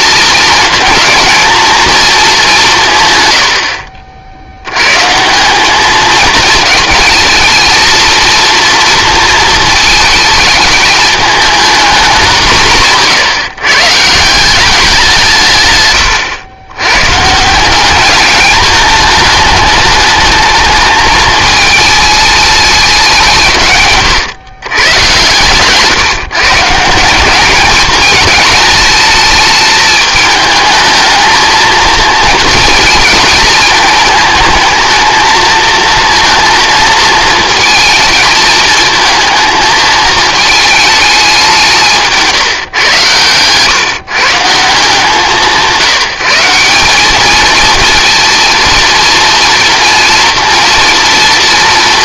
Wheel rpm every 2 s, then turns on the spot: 220, 160, 120, 220, 230, 210, 170, 190, 110, 210, 220, 210, 120, 160, 220, 220, 220, 220, 220, 220, 210, 130, 170, 190, 230, 230.
none